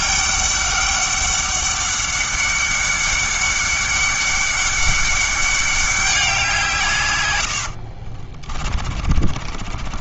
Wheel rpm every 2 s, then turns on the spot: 200, 200, 200, 160, 40.
8-10